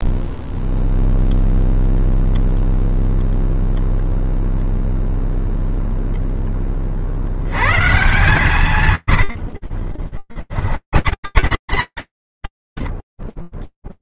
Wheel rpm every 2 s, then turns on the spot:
0, 0, 0, 150, 50, 80, 0.
8-12